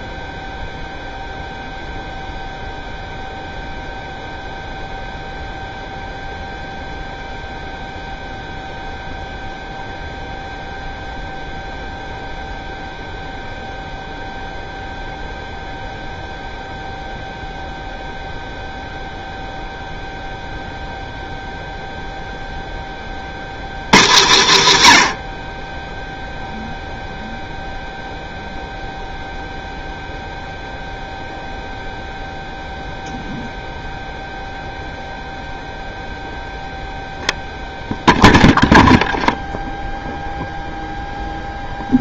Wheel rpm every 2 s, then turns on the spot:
0, 0, 0, 0, 0, 0, 0, 0, 0, 0, 0, 30, 140, 0, 0, 0, 0, 0, 0, 0, 0.
none